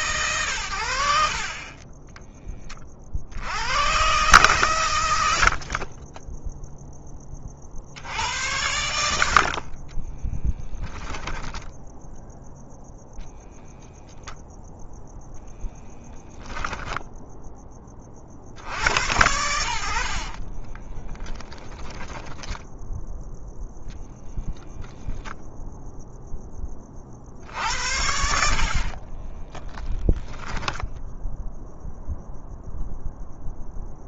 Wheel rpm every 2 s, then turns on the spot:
80, 40, 120, 10, 80, 10, 0, 0, 10, 70, 20, 10, 10, 30, 50, 10, 0.
20-22 28-30